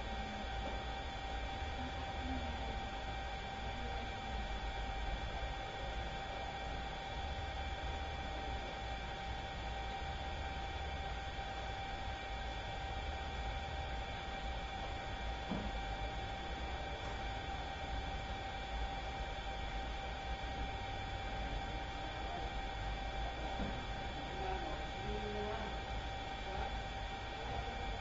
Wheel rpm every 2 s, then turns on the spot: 0, 0, 0, 0, 0, 0, 0, 0, 0, 0, 0, 0, 0, 0.
none